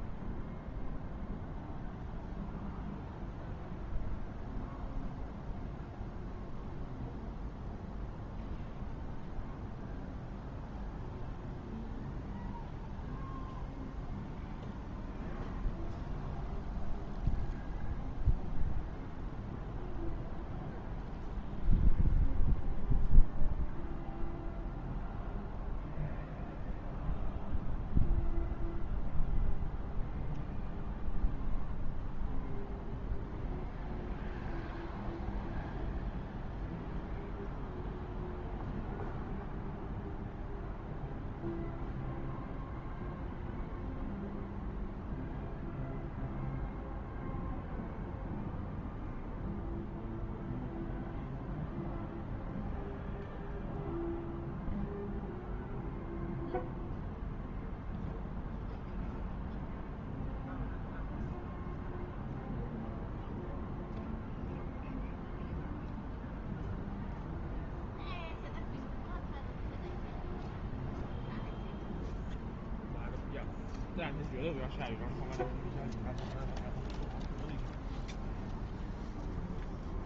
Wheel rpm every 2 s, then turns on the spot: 0, 0, 0, 0, 0, 0, 0, 0, 0, 0, 0, 0, 0, 0, 0, 0, 0, 0, 0, 0, 0, 0, 0, 0, 0, 0, 0, 0, 0, 0, 0, 0, 0, 0, 0, 0, 0, 0, 0, 0.
none